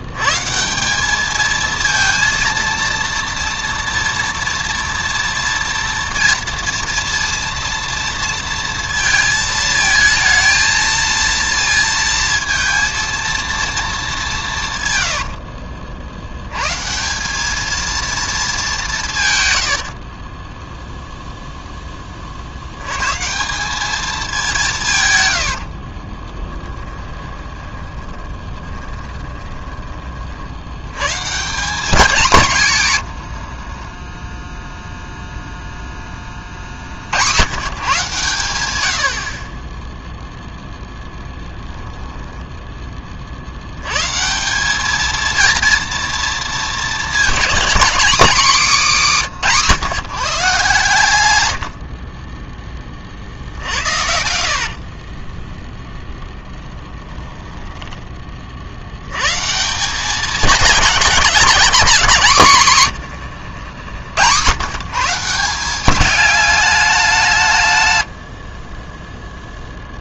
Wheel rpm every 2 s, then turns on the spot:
180, 230, 230, 230, 230, 230, 230, 130, 140, 190, 0, 100, 160, 10, 30, 100, 150, 0, 50, 80, 0, 20, 200, 230, 220, 130, 30, 40, 10, 70, 210, 130, 130, 200, 30.
14-16 26-30 54-58 62-64 68-70